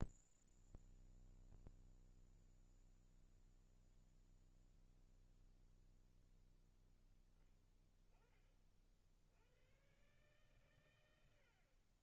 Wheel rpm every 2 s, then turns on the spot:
0, 0, 0, 0, 30, 120.
none